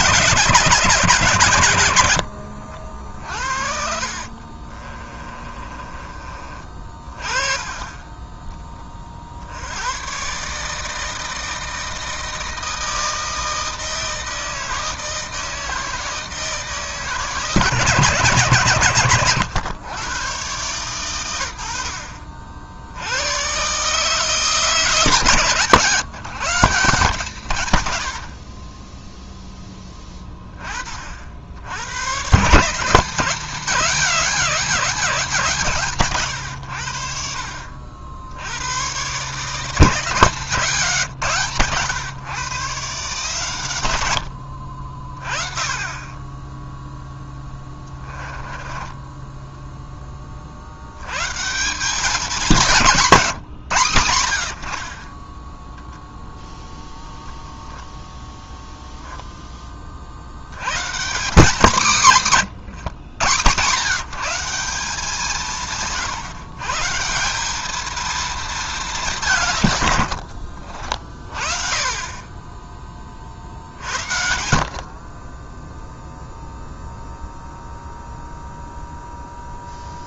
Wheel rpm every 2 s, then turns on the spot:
160, 70, 30, 30, 40, 160, 160, 160, 150, 120, 110, 80, 140, 160, 0, 60, 180, 190, 70, 120, 150, 130, 50, 10, 10, 70, 180, 50, 0, 0, 120, 160, 170, 150, 210, 50, 20, 60, 0, 0.
2-8 48-50